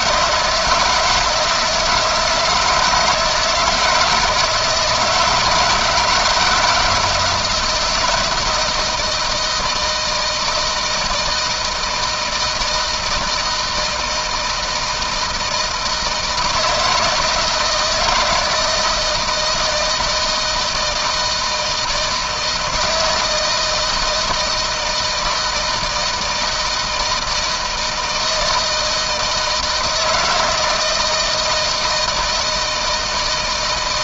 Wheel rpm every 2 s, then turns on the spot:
160, 160, 160, 170, 160, 160, 170, 160, 160, 160, 160, 160, 160, 160, 160, 160, 160.
none